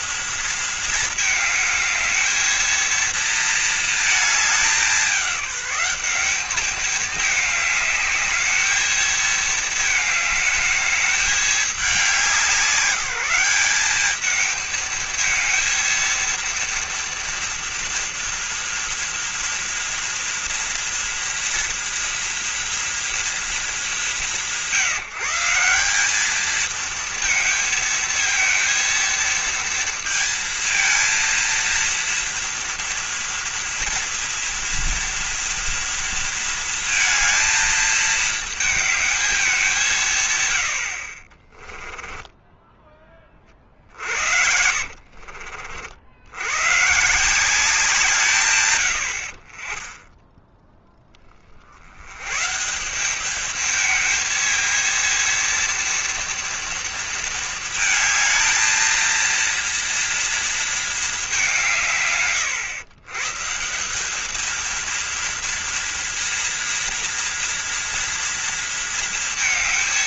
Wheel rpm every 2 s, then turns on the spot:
220, 230, 210, 210, 220, 210, 190, 220, 230, 230, 230, 230, 170, 220, 230, 230, 230, 230, 230, 220, 90, 10, 70, 120, 100, 10, 170, 220, 230, 220, 230, 120, 230, 230, 230.
44-46